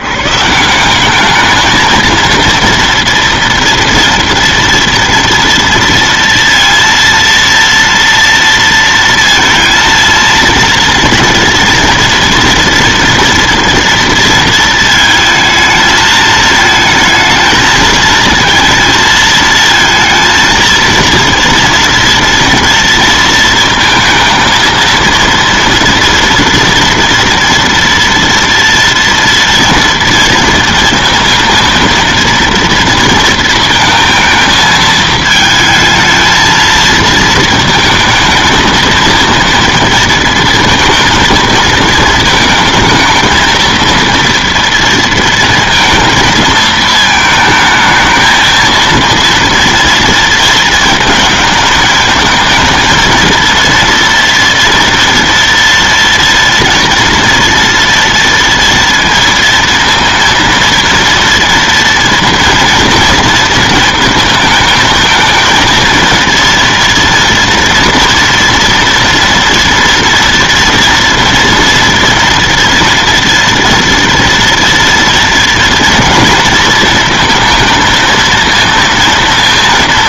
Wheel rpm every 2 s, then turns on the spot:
150, 230, 230, 230, 230, 230, 230, 220, 220, 230, 230, 230, 230, 230, 230, 230, 230, 220, 220, 220, 230, 220, 230, 220, 220, 230, 220, 230, 230, 230, 230, 230, 230, 230, 230, 240, 240, 230, 230, 230.
none